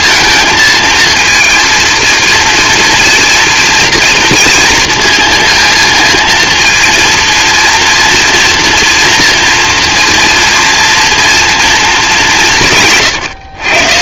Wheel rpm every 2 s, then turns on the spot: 230, 230, 230, 230, 230, 230, 150.
none